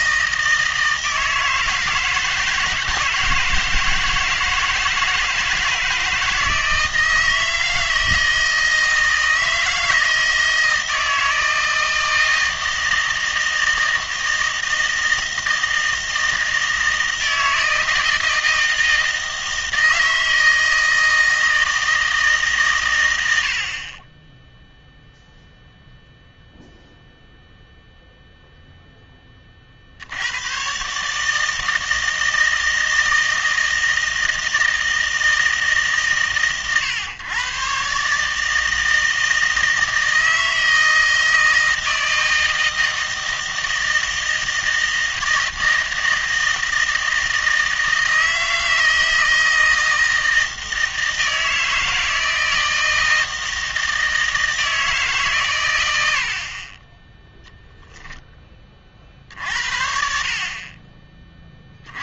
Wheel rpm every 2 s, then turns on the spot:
160, 160, 160, 160, 160, 160, 160, 160, 160, 160, 160, 140, 0, 0, 0, 130, 160, 160, 120, 160, 160, 160, 160, 160, 160, 160, 160, 160, 20, 30, 30.
none